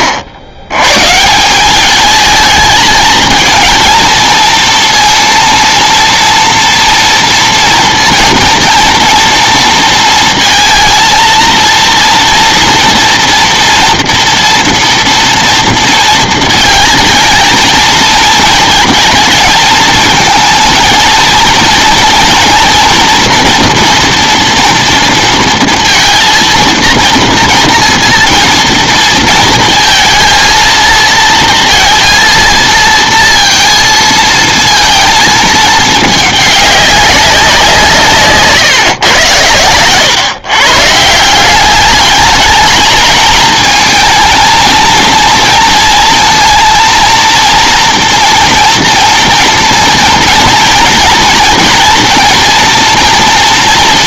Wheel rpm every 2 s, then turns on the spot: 100, 220, 230, 230, 230, 220, 230, 230, 230, 220, 230, 240, 230, 230, 230, 230, 230, 220, 200, 130, 140, 220, 230, 230, 230, 230, 230.
none